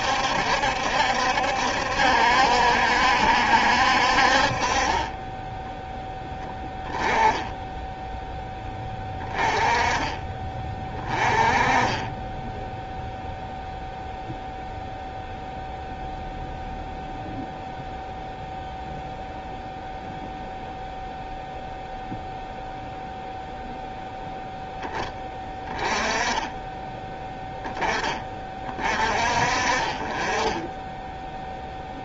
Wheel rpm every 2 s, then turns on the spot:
70, 70, 30, 10, 10, 20, 0, 0, 0, 0, 0, 0, 10, 20, 40, 10.
4-6